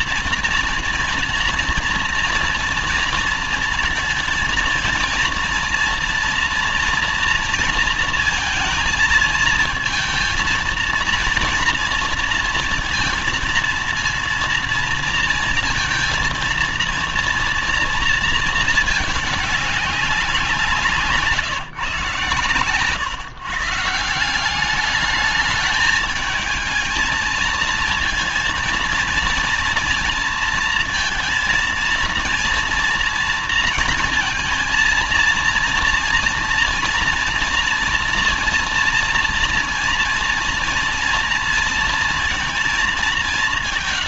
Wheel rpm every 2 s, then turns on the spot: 230, 230, 230, 230, 230, 230, 230, 230, 230, 220, 170, 110, 190, 220, 230, 230, 230, 230, 230, 230, 230, 210.
none